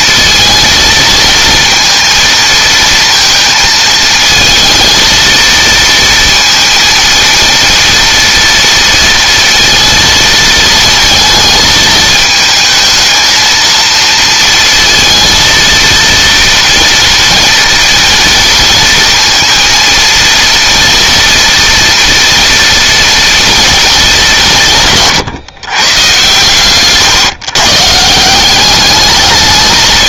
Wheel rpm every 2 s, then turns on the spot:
230, 230, 230, 230, 230, 220, 220, 230, 230, 230, 230, 230, 140, 130, 200.
none